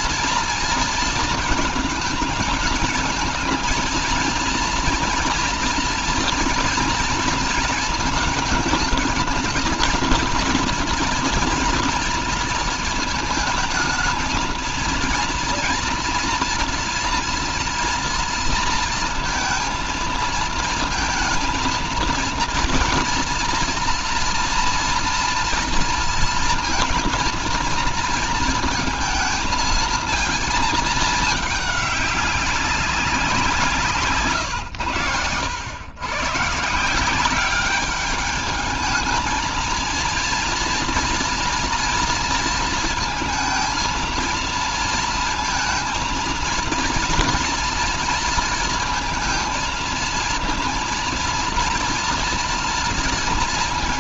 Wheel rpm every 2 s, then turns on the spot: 230, 220, 230, 230, 220, 240, 230, 230, 240, 230, 220, 230, 230, 230, 230, 220, 190, 100, 160, 210, 230, 230, 220, 230, 230, 230, 230.
none